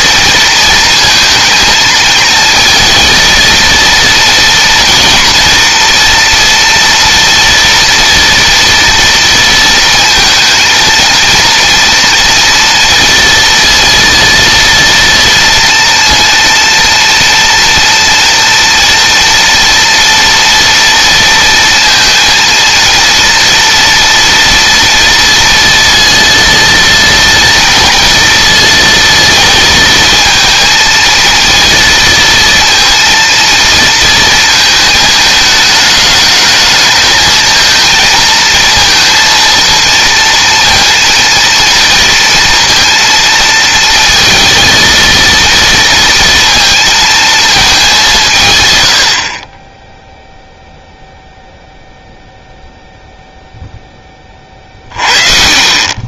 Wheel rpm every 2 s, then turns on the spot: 230, 220, 230, 230, 230, 230, 230, 230, 230, 230, 230, 230, 230, 230, 230, 230, 230, 220, 220, 230, 230, 230, 230, 230, 120, 0, 0, 40.
none